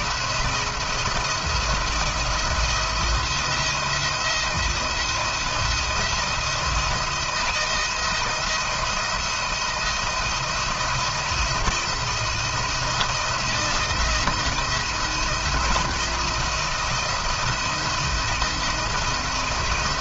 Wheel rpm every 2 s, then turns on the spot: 170, 170, 170, 170, 170, 170, 170, 170, 170, 170.
none